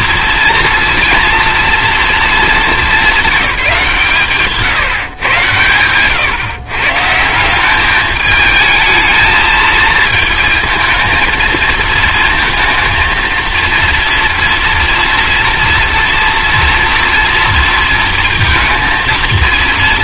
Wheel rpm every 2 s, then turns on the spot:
230, 190, 120, 170, 220, 230, 230, 240, 230, 230.
none